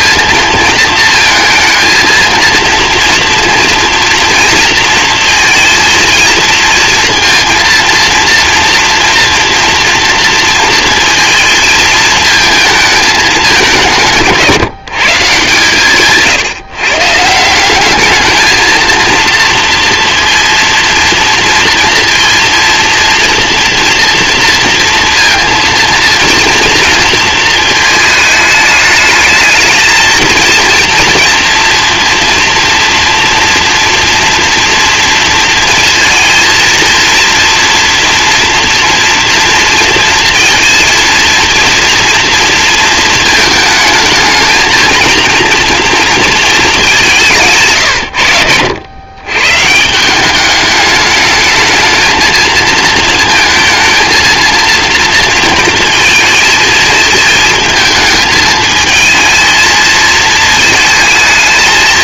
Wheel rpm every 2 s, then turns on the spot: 230, 230, 230, 230, 240, 230, 220, 160, 120, 220, 230, 230, 230, 230, 220, 230, 230, 230, 230, 240, 230, 220, 220, 210, 100, 210, 220, 230, 220, 220, 220.
none